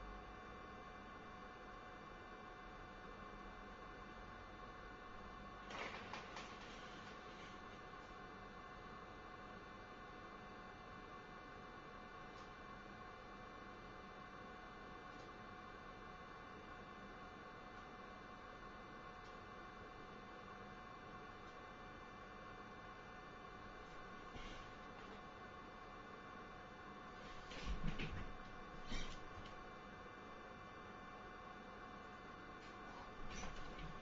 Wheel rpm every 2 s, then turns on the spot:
0, 0, 0, 0, 0, 0, 0, 0, 0, 0, 0, 0, 0, 0, 0, 0, 0.
none